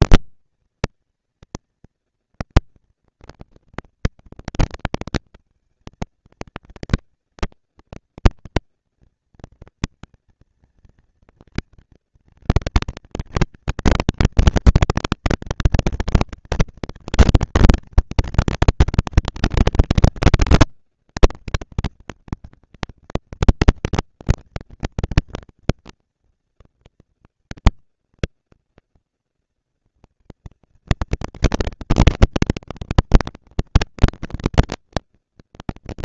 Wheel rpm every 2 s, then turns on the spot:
220, 230, 220, 230, 230, 230, 230, 230, 230, 220, 200, 210, 230, 230, 230, 230, 230, 230.
none